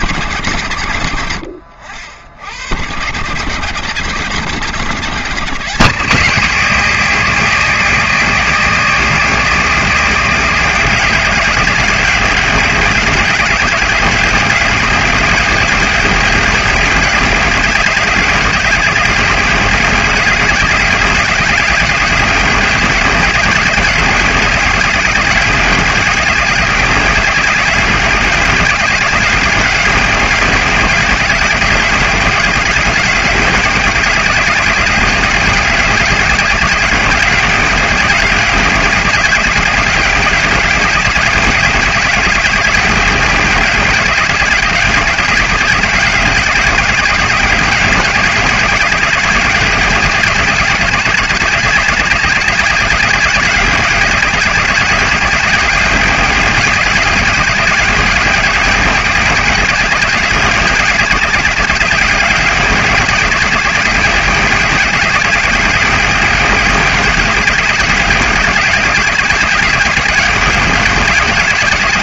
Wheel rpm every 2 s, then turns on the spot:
90, 110, 160, 190, 190, 190, 200, 190, 200, 210, 190, 190, 190, 200, 200, 190, 200, 210, 190, 200, 200, 210, 190, 210, 210, 190, 210, 180, 190, 210, 200, 170, 190, 210, 200, 200.
none